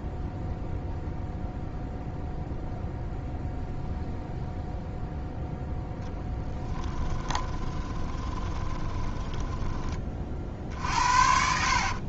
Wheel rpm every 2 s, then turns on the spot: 0, 0, 0, 20, 20, 60.
6-12